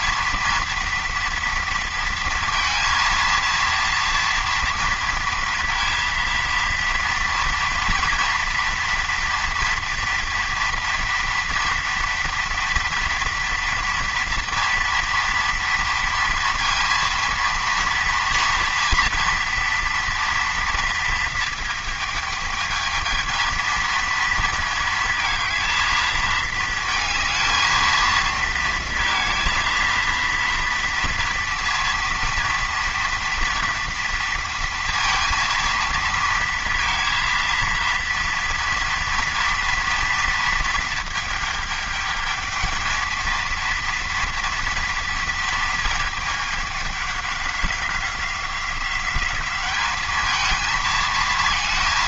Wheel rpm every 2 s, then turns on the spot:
230, 230, 230, 230, 230, 230, 230, 230, 230, 230, 230, 220, 230, 220, 230, 230, 230, 230, 230, 230, 220, 220, 230, 210, 180, 220.
none